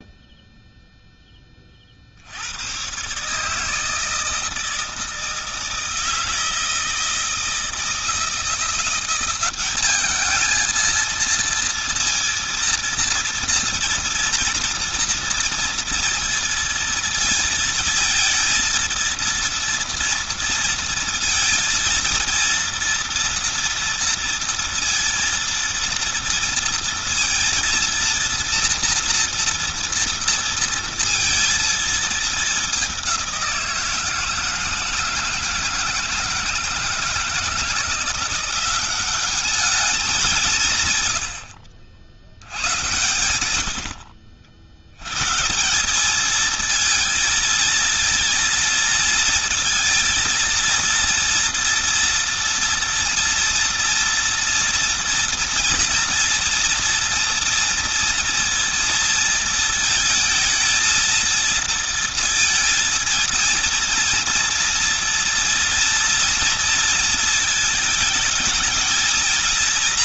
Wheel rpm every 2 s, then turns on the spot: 0, 120, 160, 160, 180, 220, 230, 230, 230, 230, 230, 230, 230, 230, 230, 230, 190, 160, 160, 190, 130, 100, 110, 230, 230, 230, 230, 230, 230, 230, 230, 230, 230, 230, 220.
none